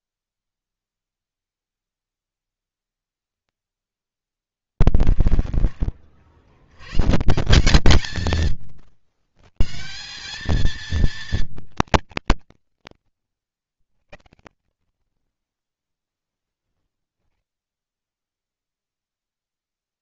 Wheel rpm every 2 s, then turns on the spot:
0, 10, 20, 120, 110, 230, 110, 30, 10, 0.
4-6